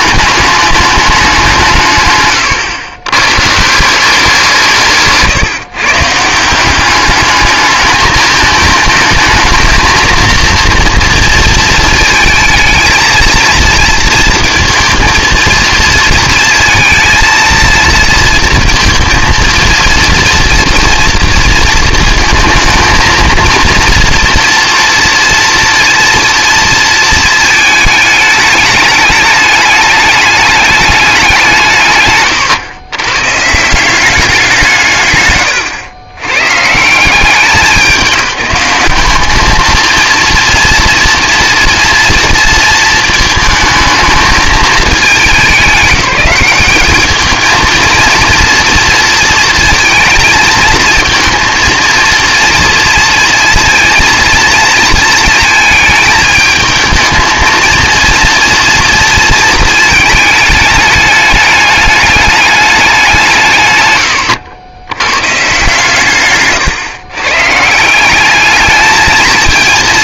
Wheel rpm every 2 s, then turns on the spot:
210, 120, 170, 180, 220, 230, 220, 230, 230, 230, 230, 220, 230, 230, 210, 210, 110, 170, 110, 190, 230, 230, 220, 190, 230, 220, 230, 220, 220, 230, 210, 200, 100, 140, 210.
2-4 66-68